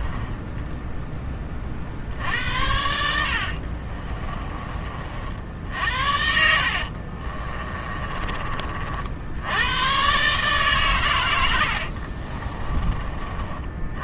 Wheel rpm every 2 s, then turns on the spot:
10, 70, 40, 50, 60, 120, 30.
2-4 6-8